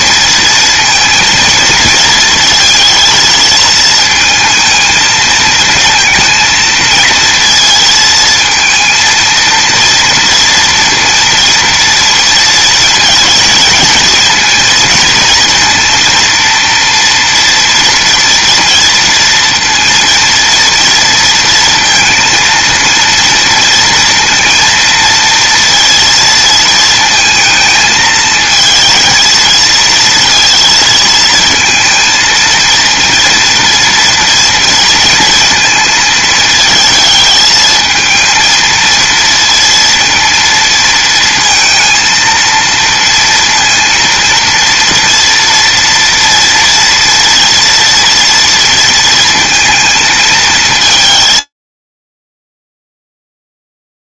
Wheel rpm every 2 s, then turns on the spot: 230, 220, 220, 230, 230, 230, 230, 230, 230, 230, 230, 230, 230, 220, 230, 230, 230, 220, 220, 230, 230, 230, 230, 230, 230, 170, 0.
none